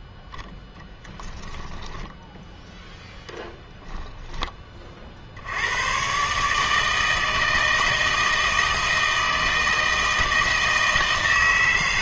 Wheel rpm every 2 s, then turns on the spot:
0, 0, 20, 150, 160, 160.
none